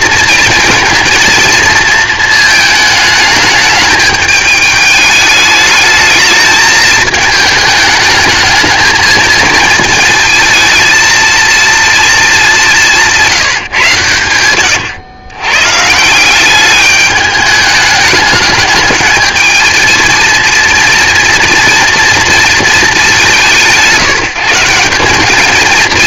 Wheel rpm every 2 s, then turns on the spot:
220, 220, 210, 210, 220, 220, 190, 100, 200, 210, 230, 220, 160.
none